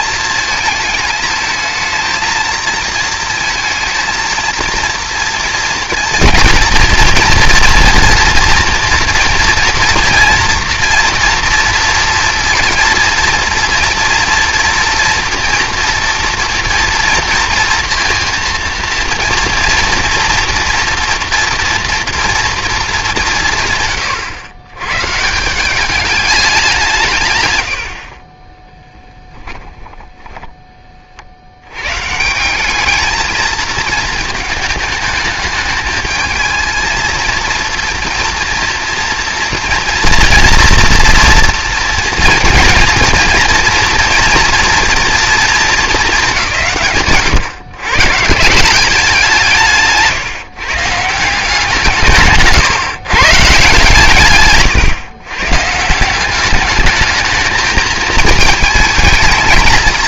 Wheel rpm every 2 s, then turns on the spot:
220, 230, 230, 230, 230, 230, 240, 230, 230, 230, 230, 210, 120, 170, 10, 30, 210, 220, 220, 230, 230, 230, 240, 140, 190, 150, 130, 120, 210, 220.
28-30